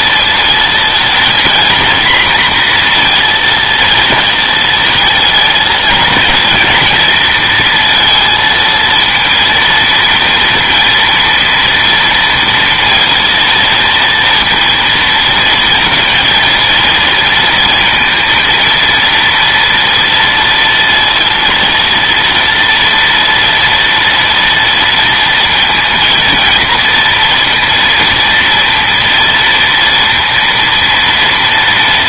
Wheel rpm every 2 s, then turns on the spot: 230, 240, 230, 220, 230, 230, 230, 230, 230, 230, 230, 230, 230, 230, 230, 230.
none